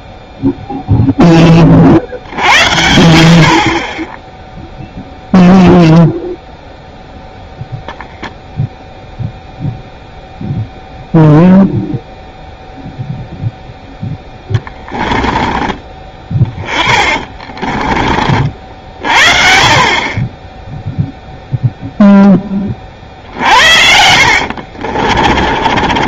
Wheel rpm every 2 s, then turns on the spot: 0, 70, 0, 0, 0, 0, 0, 10, 20, 50, 10, 20, 60.
14-18 24-26